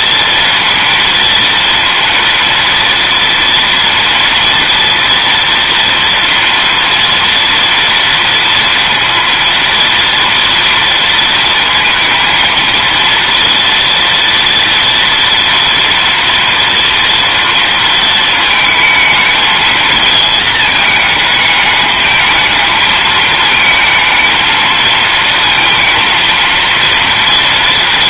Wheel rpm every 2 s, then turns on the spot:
230, 230, 230, 230, 230, 230, 230, 230, 230, 220, 220, 220, 220, 230.
none